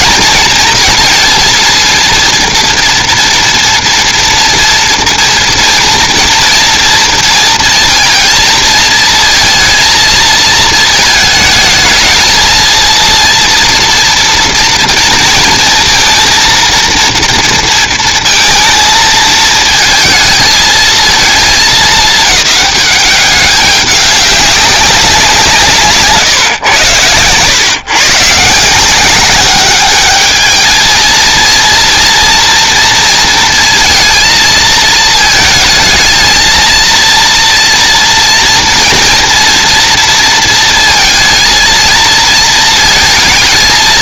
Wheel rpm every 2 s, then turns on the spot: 230, 230, 240, 230, 220, 220, 230, 230, 230, 230, 220, 200, 190, 110, 160, 220, 230, 220, 230, 240, 230, 230.
none